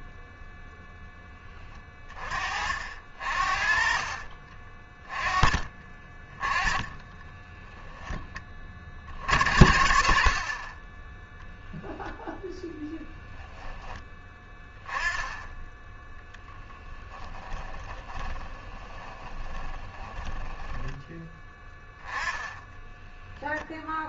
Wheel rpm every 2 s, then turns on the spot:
0, 50, 30, 20, 30, 20, 0, 10, 10, 20, 10, 10.
6-8 16-22